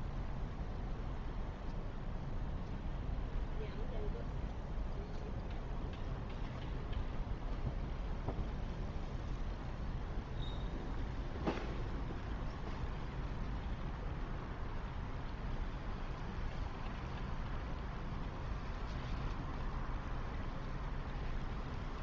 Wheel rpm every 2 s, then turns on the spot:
0, 0, 0, 0, 0, 0, 0, 0, 0, 0, 0.
none